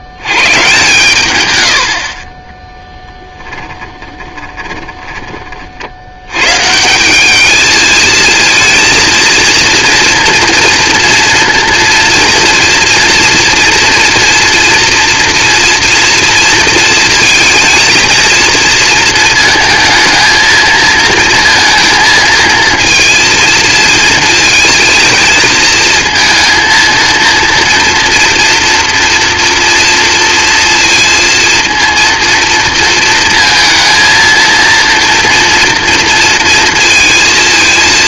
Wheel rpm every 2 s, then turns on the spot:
70, 20, 20, 130, 220, 230, 230, 240, 230, 230, 220, 230, 230, 230, 230, 230, 230, 230, 230.
4-6